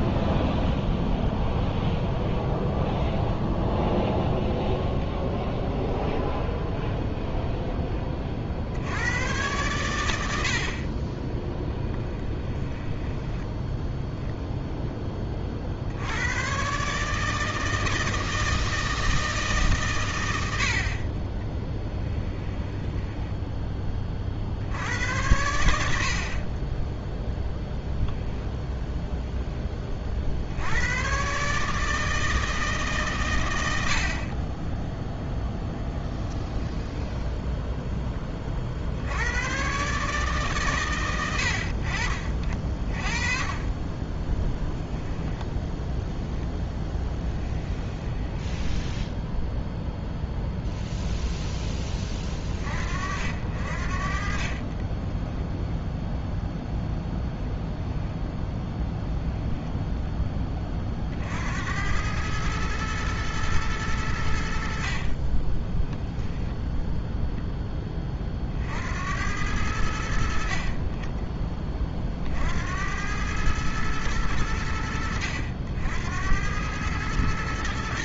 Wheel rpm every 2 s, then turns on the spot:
10, 0, 0, 0, 70, 50, 10, 0, 130, 160, 70, 10, 70, 20, 0, 90, 150, 20, 10, 50, 130, 30, 10, 10, 10, 0, 40, 30, 0, 10, 30, 110, 60, 10, 50, 40, 70, 90, 100.
0-2 12-14 22-24 48-50 54-56 58-60 66-68